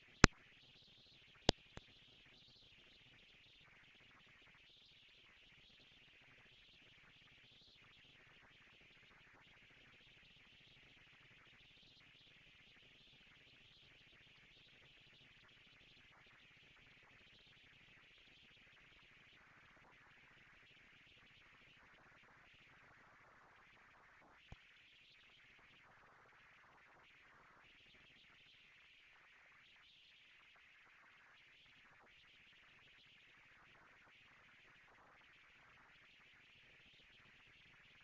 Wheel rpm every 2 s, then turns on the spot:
220, 190, 110, 170, 230, 230, 230, 230, 230, 230, 230, 220, 230, 240, 230, 230, 230, 230, 230.
none